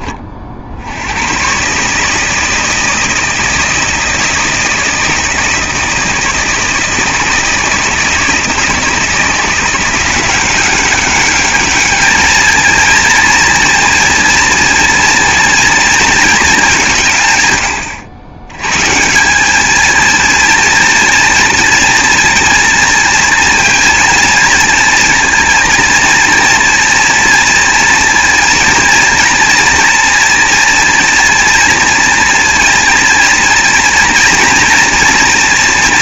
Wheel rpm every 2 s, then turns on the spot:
70, 160, 160, 160, 160, 190, 220, 230, 190, 130, 230, 230, 230, 230, 230, 230, 230, 230.
none